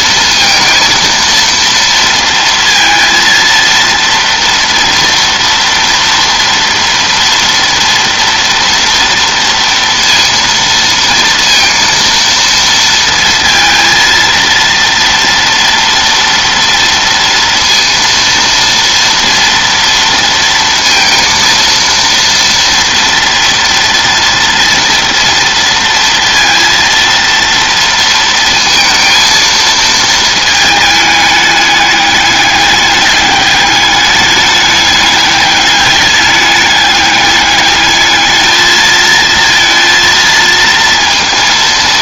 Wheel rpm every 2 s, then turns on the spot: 230, 230, 230, 230, 230, 230, 230, 230, 230, 230, 230, 230, 230, 230, 230, 220, 200, 210, 200, 220, 230.
none